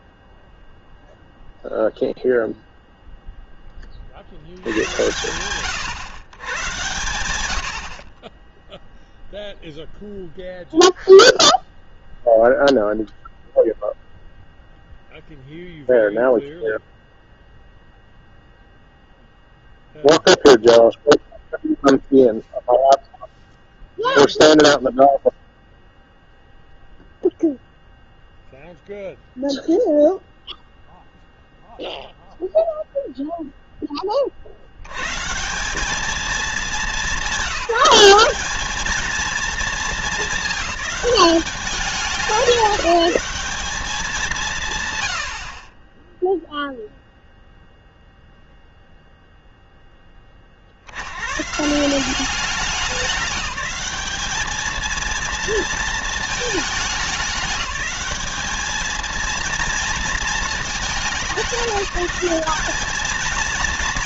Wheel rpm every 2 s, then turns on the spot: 0, 0, 70, 120, 10, 0, 0, 0, 0, 0, 0, 0, 0, 0, 0, 0, 0, 70, 210, 210, 210, 200, 140, 0, 0, 50, 190, 210, 220, 210, 210, 200.
none